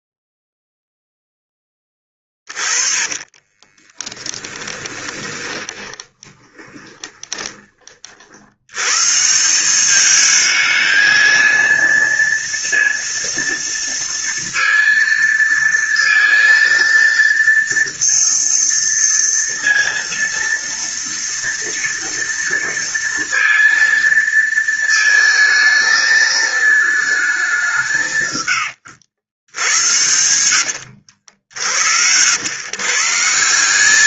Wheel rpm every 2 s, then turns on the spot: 0, 30, 10, 20, 120, 220, 230, 230, 230, 230, 230, 230, 220, 220, 90, 80, 140.
2-8 28-32